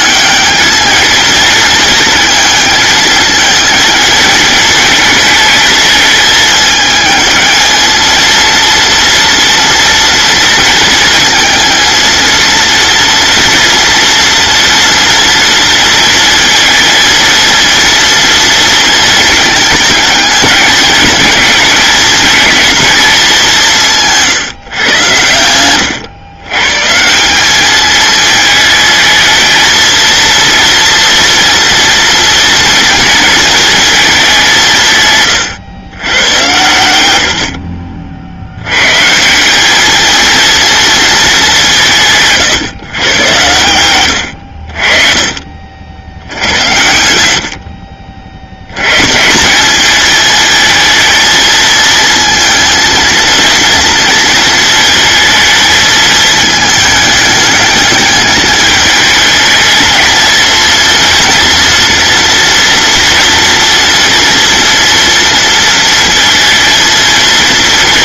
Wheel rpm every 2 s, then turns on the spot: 220, 220, 220, 220, 230, 230, 230, 230, 230, 230, 210, 220, 130, 140, 220, 230, 230, 170, 110, 110, 230, 120, 60, 80, 90, 220, 230, 230, 220, 210, 230, 240, 240, 230.
none